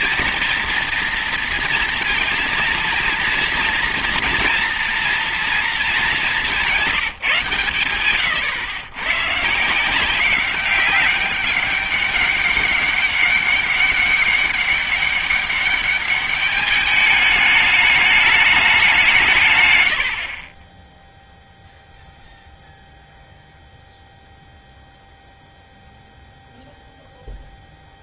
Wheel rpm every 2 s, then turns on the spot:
230, 230, 230, 180, 130, 190, 200, 200, 210, 180, 10, 0, 0, 0.
none